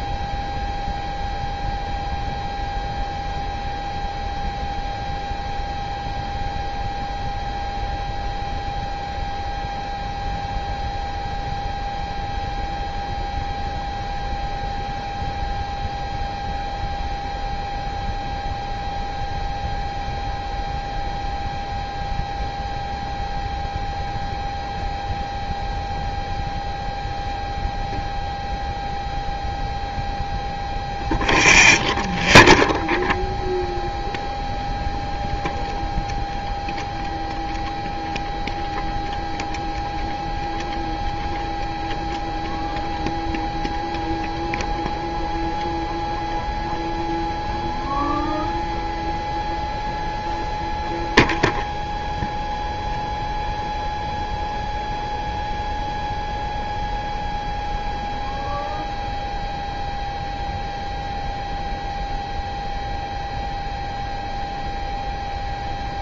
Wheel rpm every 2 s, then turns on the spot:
0, 0, 0, 0, 0, 0, 0, 0, 0, 0, 0, 0, 0, 0, 0, 0, 0, 0, 0, 0, 0, 0, 0, 0, 0, 0, 0, 0, 0, 0, 0, 0, 0.
none